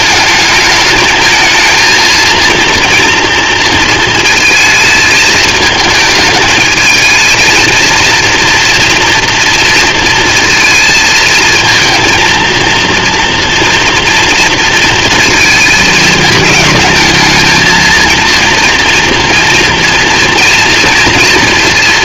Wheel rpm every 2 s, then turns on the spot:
220, 230, 220, 220, 230, 220, 230, 230, 220, 230, 230.
none